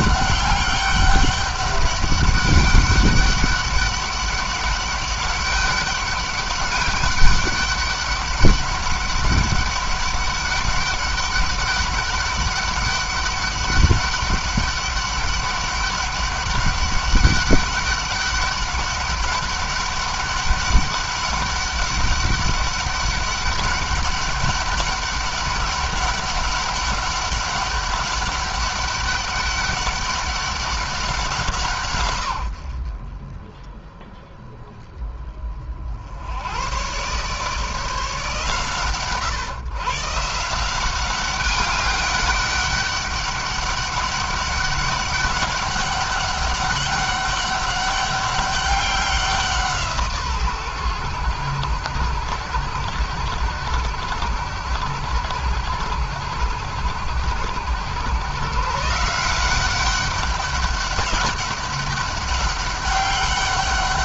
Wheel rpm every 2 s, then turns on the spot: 200, 200, 200, 200, 200, 200, 200, 200, 200, 200, 200, 200, 200, 200, 200, 190, 50, 20, 120, 130, 180, 200, 200, 200, 190, 110, 90, 90, 90, 150, 200, 200.
none